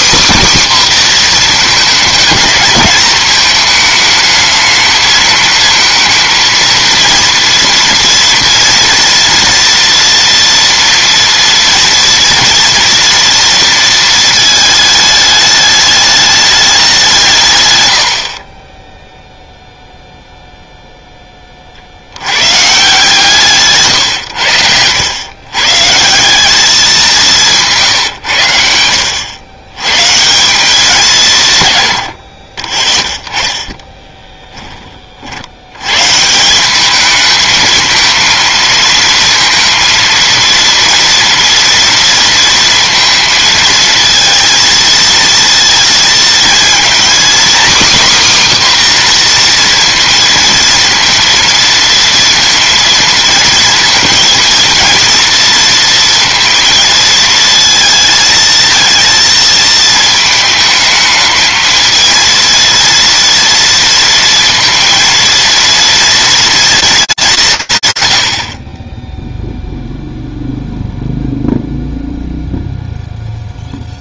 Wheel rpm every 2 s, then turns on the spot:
260, 220, 220, 230, 230, 230, 230, 220, 190, 10, 0, 140, 100, 200, 80, 180, 30, 20, 200, 230, 230, 230, 230, 240, 270, 230, 230, 230, 230, 230, 220, 230, 230, 230, 50, 0, 0.
28-30